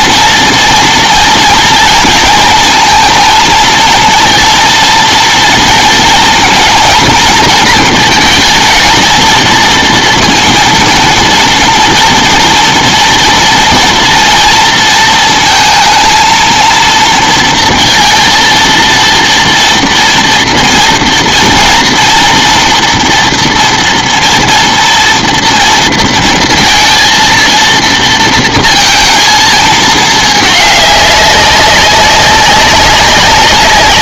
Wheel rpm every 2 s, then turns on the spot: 230, 230, 230, 230, 220, 230, 230, 230, 230, 230, 230, 230, 230, 230, 230, 210, 190.
none